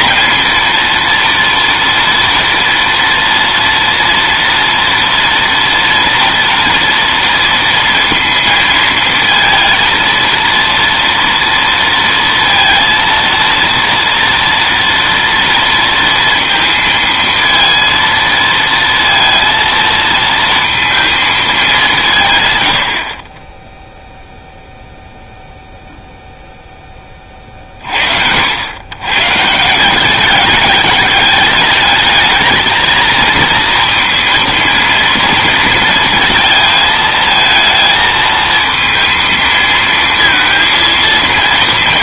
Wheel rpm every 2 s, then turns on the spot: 230, 230, 230, 230, 230, 230, 230, 230, 230, 230, 230, 120, 0, 0, 90, 200, 220, 230, 220, 220, 230.
none